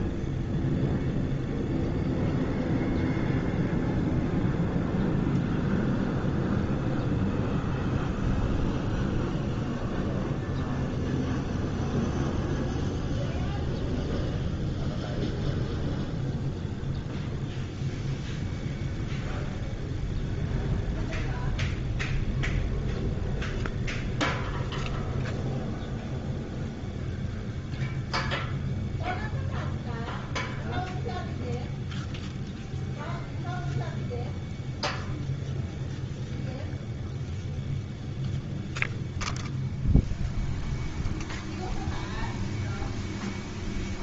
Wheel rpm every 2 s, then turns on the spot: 0, 0, 0, 0, 0, 0, 0, 0, 0, 0, 0, 0, 0, 0, 0, 0, 0, 0, 0, 0, 0, 0.
none